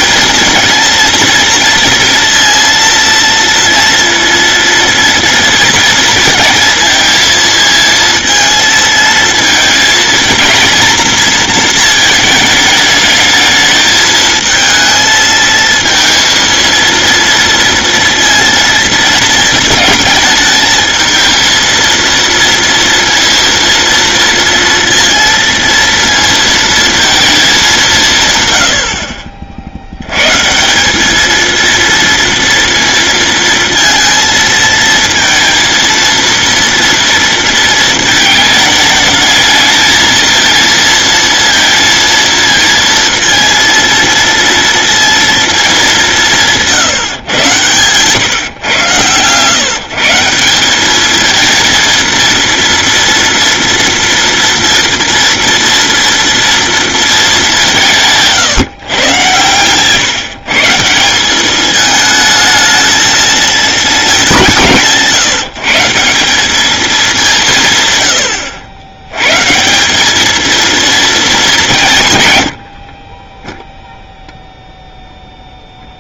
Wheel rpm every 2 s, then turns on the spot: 230, 230, 230, 230, 230, 220, 220, 220, 230, 230, 220, 230, 230, 230, 100, 180, 230, 230, 230, 220, 230, 230, 230, 150, 120, 190, 230, 230, 230, 140, 160, 220, 160, 210, 80, 230, 70, 0.
none